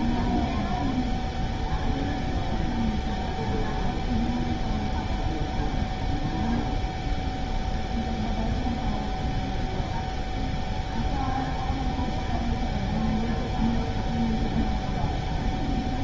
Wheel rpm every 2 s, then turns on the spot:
0, 0, 0, 0, 0, 0, 0, 0.
none